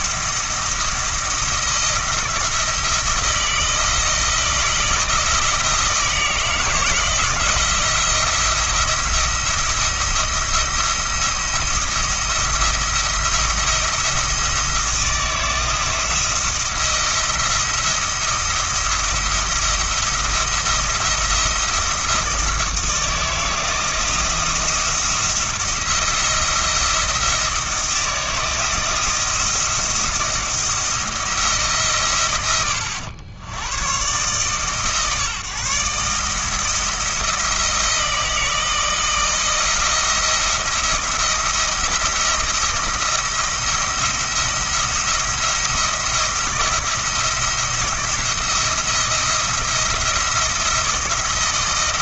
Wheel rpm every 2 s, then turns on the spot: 170, 160, 170, 160, 170, 170, 170, 170, 170, 170, 170, 160, 170, 170, 160, 170, 100, 150, 160, 160, 170, 170, 170, 170, 170, 170.
none